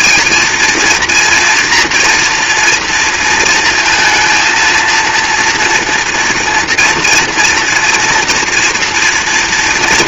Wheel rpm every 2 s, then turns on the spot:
230, 230, 230, 240, 240.
none